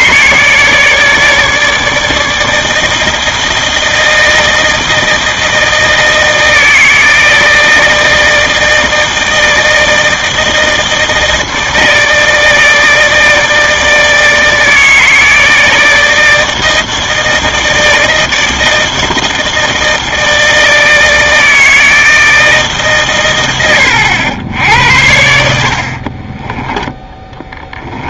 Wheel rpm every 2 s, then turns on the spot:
150, 160, 160, 160, 160, 160, 160, 160, 160, 160, 160, 150, 80, 20.
26-28